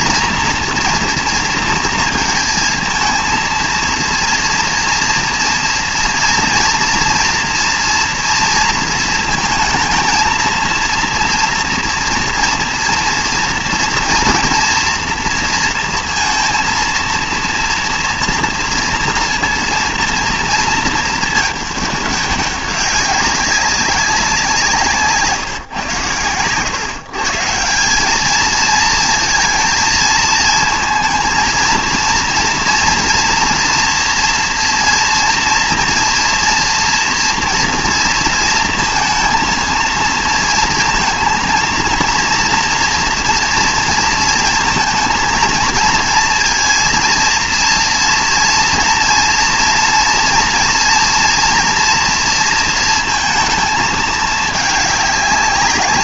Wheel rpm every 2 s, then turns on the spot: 240, 220, 230, 230, 220, 230, 230, 230, 230, 230, 230, 200, 160, 130, 220, 230, 240, 230, 240, 230, 230, 230, 230, 230, 230, 230, 230, 210.
none